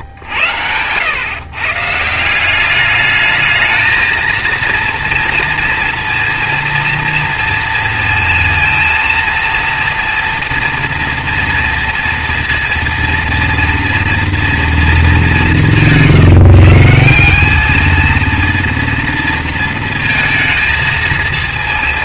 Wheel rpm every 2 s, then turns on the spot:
110, 210, 230, 230, 230, 230, 230, 210, 180, 230, 220.
none